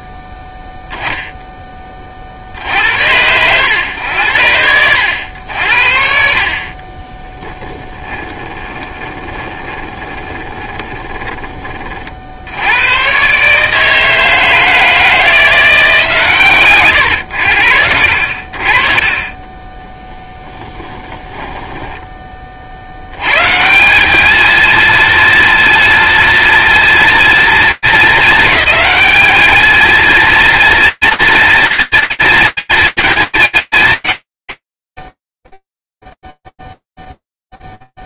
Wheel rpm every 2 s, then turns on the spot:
0, 50, 80, 40, 20, 20, 70, 160, 130, 50, 10, 50, 220, 230, 210, 230, 230, 70, 0.
8-12 20-22